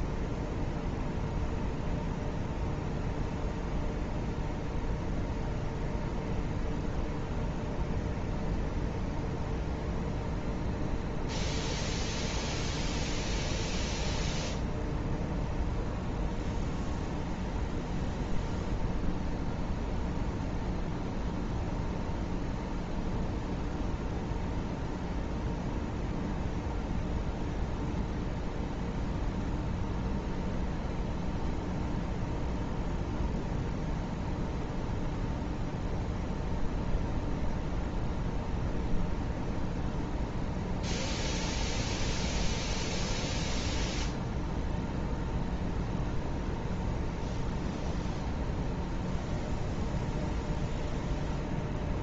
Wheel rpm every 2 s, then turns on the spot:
0, 0, 0, 0, 0, 0, 0, 0, 0, 0, 0, 0, 0, 0, 0, 0, 0, 0, 0, 0, 0, 0, 0, 0, 0, 0.
none